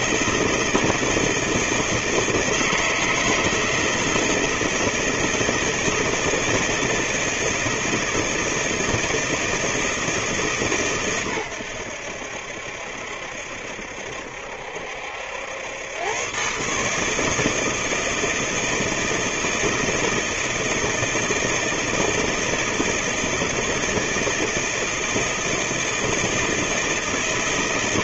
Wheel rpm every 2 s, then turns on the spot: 160, 160, 160, 160, 160, 150, 70, 70, 140, 160, 160, 160, 160, 160.
none